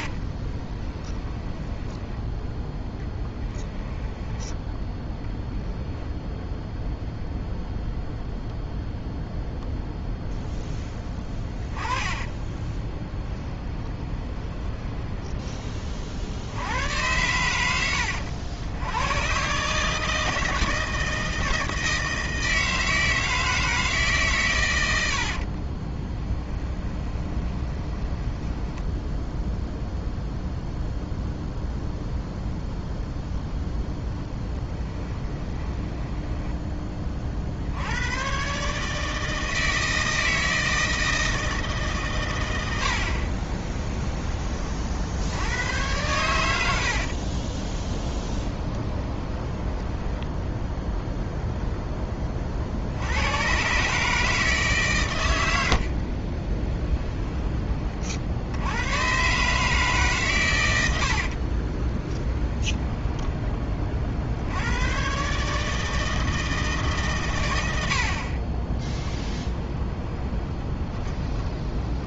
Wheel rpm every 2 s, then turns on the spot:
20, 10, 10, 0, 0, 10, 20, 20, 100, 100, 160, 160, 90, 20, 10, 0, 0, 20, 20, 150, 160, 70, 50, 60, 20, 0, 70, 140, 10, 110, 90, 10, 110, 140, 10, 20.
0-4 10-16 26-30 34-36 46-50 56-58 62-64 68-72